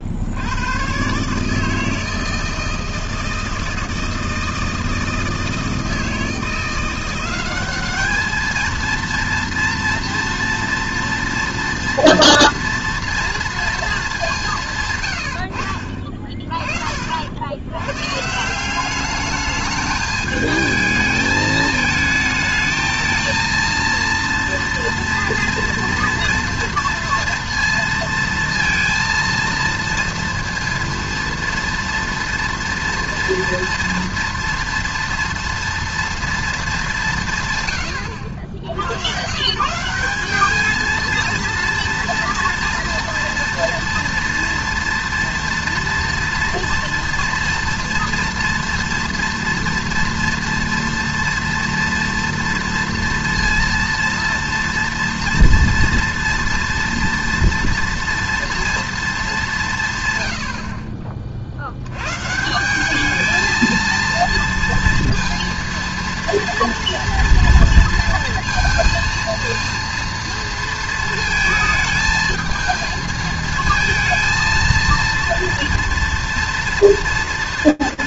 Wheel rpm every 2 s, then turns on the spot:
100, 160, 160, 170, 220, 230, 230, 170, 30, 180, 220, 220, 230, 230, 230, 230, 230, 230, 220, 90, 210, 230, 240, 230, 230, 230, 230, 230, 230, 230, 70, 170, 230, 230, 230, 230, 220, 230, 230.
none